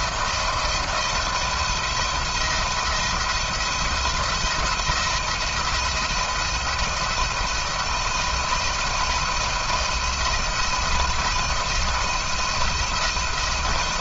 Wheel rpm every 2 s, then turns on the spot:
160, 170, 170, 170, 170, 170, 170.
none